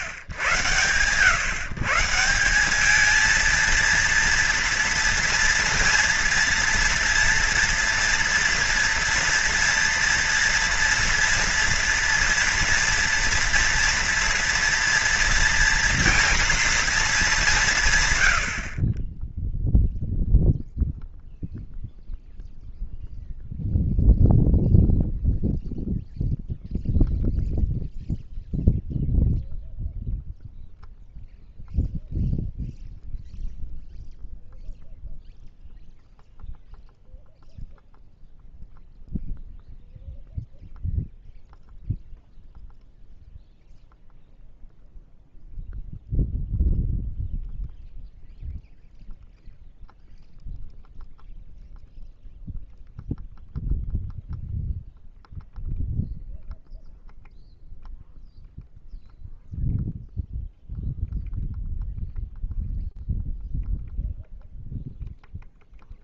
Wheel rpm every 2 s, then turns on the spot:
100, 180, 240, 230, 230, 230, 230, 230, 230, 80, 0, 0, 0, 0, 0, 0, 0, 0, 0, 0, 0, 0, 0, 0, 0, 0, 0, 0, 0, 0, 0, 0, 0.
none